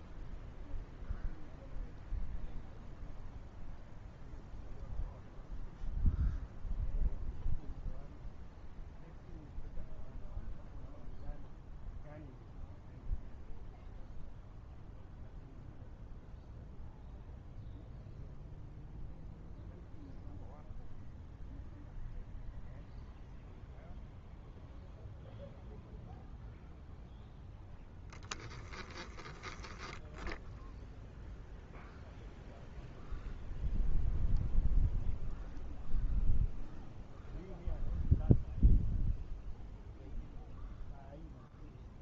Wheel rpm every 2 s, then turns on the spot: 0, 0, 0, 0, 0, 0, 0, 0, 0, 0, 0, 0, 0, 0, 10, 0, 0, 0, 0, 0, 0.
none